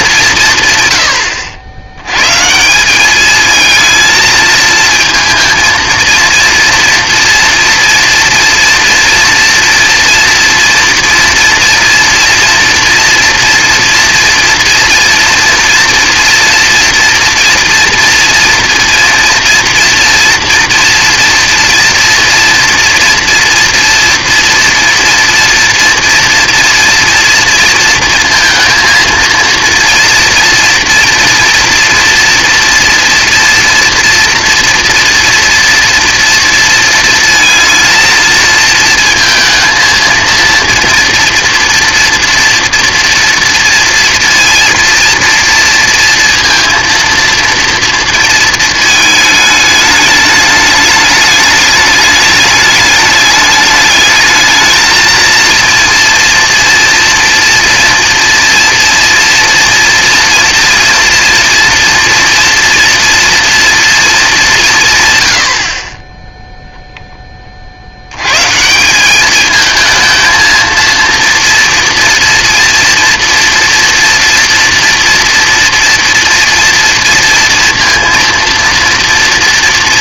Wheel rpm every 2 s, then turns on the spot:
140, 170, 220, 230, 230, 230, 230, 230, 230, 230, 240, 240, 240, 230, 230, 230, 240, 230, 230, 230, 230, 230, 230, 230, 220, 210, 210, 220, 230, 230, 230, 230, 190, 0, 140, 230, 230, 230, 230, 230.
none